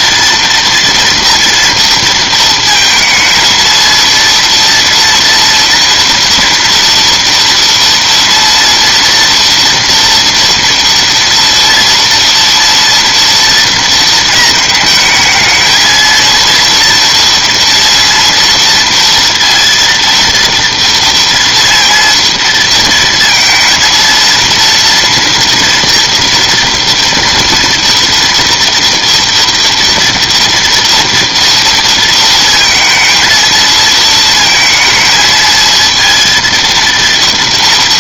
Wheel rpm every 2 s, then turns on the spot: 230, 220, 230, 230, 230, 230, 230, 220, 230, 230, 230, 230, 230, 240, 230, 230, 230, 220, 230.
none